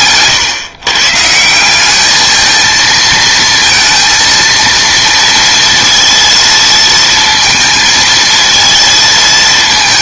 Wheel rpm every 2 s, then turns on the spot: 140, 220, 230, 220, 230.
none